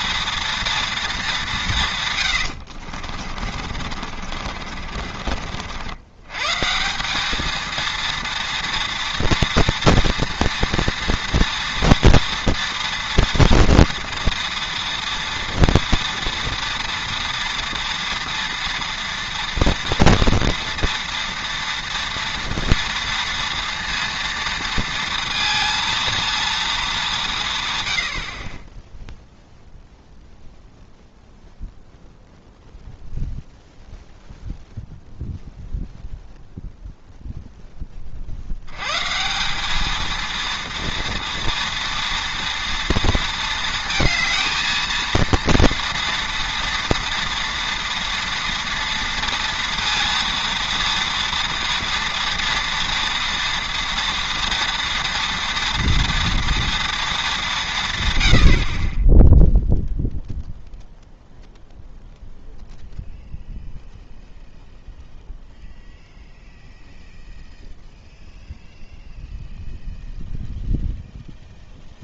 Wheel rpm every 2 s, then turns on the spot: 230, 80, 50, 150, 230, 230, 240, 230, 230, 230, 230, 230, 230, 220, 20, 0, 0, 0, 0, 90, 230, 230, 220, 230, 230, 230, 230, 230, 230, 60, 0, 0, 0, 0, 0, 0.
2-6